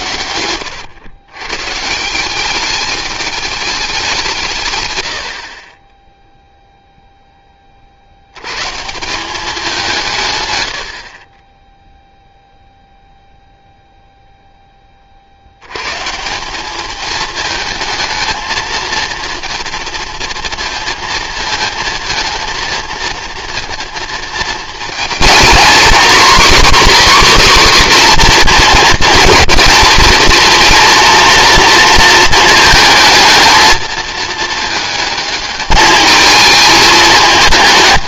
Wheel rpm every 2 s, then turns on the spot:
110, 210, 90, 10, 190, 30, 0, 30, 220, 230, 230, 230, 230, 280, 220, 230, 220, 220, 220.
none